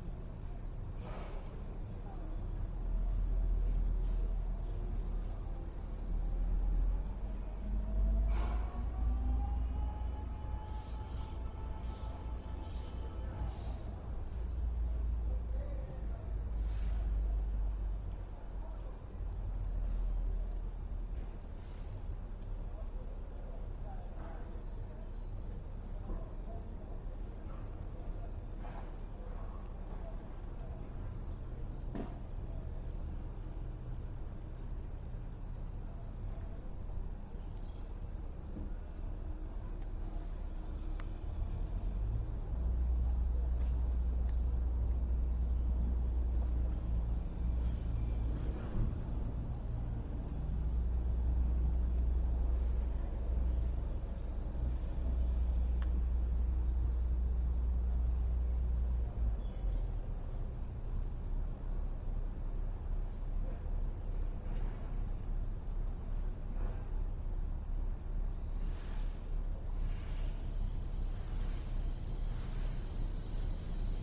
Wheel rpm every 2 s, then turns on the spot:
0, 0, 0, 0, 0, 0, 0, 0, 0, 0, 0, 0, 0, 0, 0, 0, 0, 0, 0, 0, 0, 0, 0, 0, 0, 0, 0, 0, 0, 0, 0, 0, 0, 0, 0, 0, 0.
none